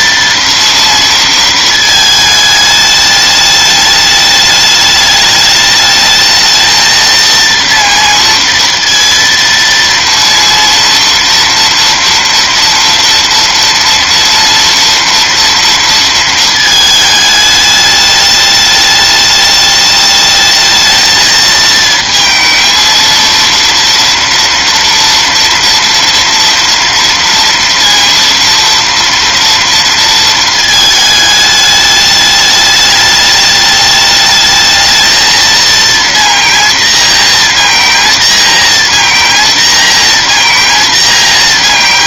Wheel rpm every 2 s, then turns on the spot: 230, 210, 210, 230, 230, 240, 230, 230, 220, 210, 220, 230, 230, 230, 230, 220, 210, 220, 230, 230, 230.
none